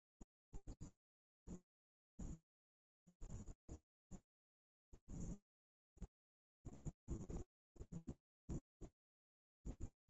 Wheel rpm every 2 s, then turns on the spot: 0, 0, 0, 0, 0.
none